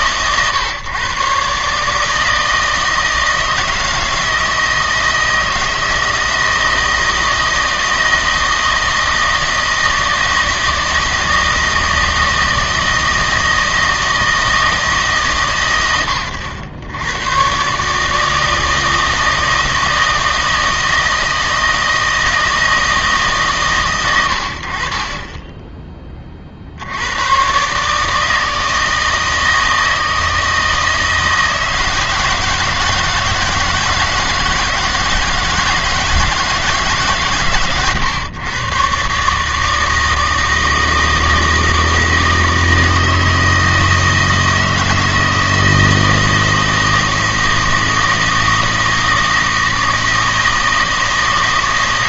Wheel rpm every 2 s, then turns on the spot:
130, 160, 160, 160, 160, 160, 160, 160, 80, 160, 160, 160, 70, 60, 160, 160, 160, 160, 160, 120, 160, 160, 160, 160, 160, 160.
none